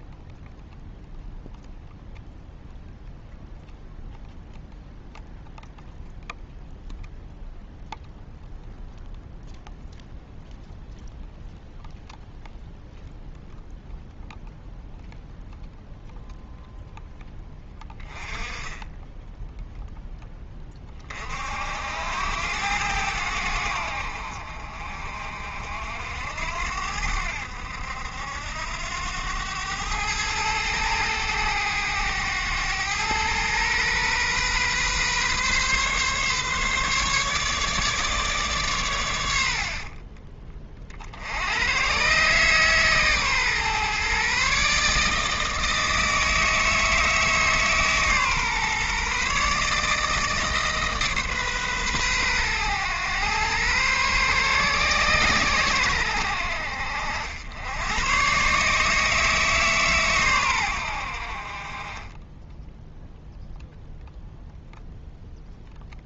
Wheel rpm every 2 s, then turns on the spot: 0, 0, 0, 0, 0, 0, 0, 0, 0, 10, 20, 90, 50, 80, 90, 110, 110, 130, 150, 120, 30, 140, 140, 160, 140, 150, 110, 130, 70, 150, 90, 10, 0.
18-20